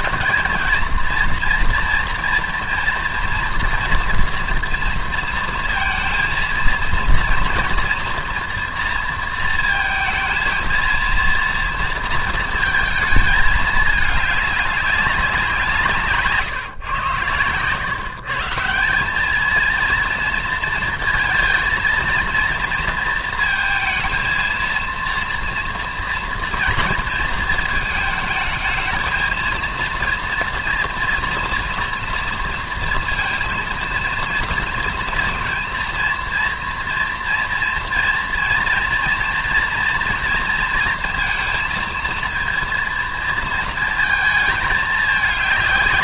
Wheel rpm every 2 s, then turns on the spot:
230, 240, 230, 230, 230, 230, 220, 200, 130, 180, 230, 230, 230, 230, 220, 230, 230, 230, 230, 230, 230, 230, 210.
none